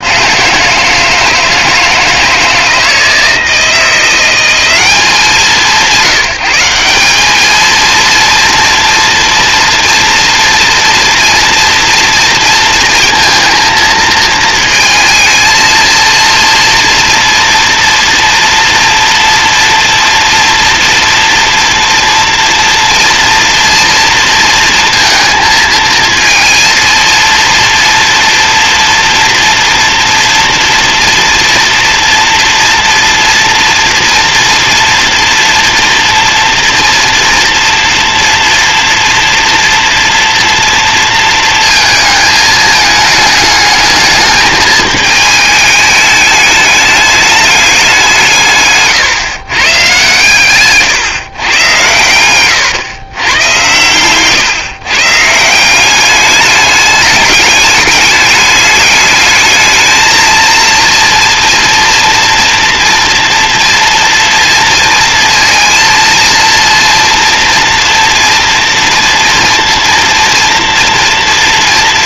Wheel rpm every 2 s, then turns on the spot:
160, 160, 190, 200, 230, 230, 230, 230, 230, 230, 240, 240, 230, 230, 240, 230, 230, 230, 240, 240, 230, 210, 210, 210, 140, 120, 110, 150, 210, 210, 230, 230, 230, 230, 230, 230.
none